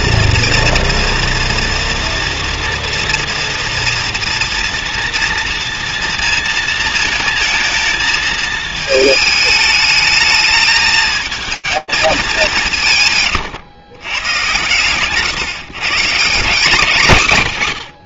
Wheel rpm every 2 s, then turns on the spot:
230, 230, 230, 230, 230, 220, 200, 130, 180.
none